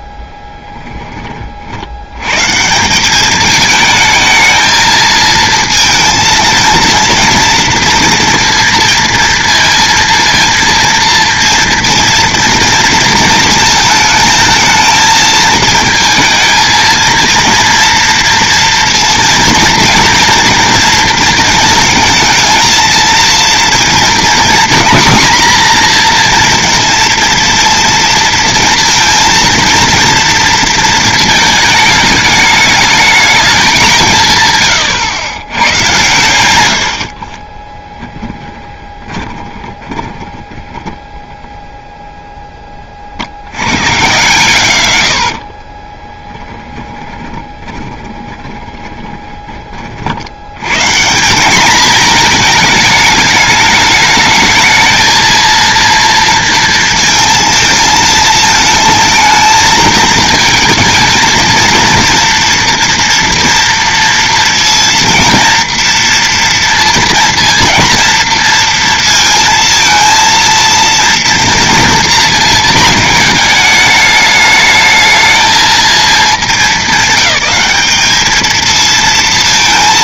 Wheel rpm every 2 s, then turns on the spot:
10, 160, 220, 230, 230, 230, 230, 220, 230, 230, 230, 220, 230, 230, 230, 230, 210, 120, 90, 20, 10, 20, 110, 20, 20, 130, 220, 220, 230, 220, 220, 230, 230, 230, 230, 230, 220, 210, 200, 220.
38-40 46-50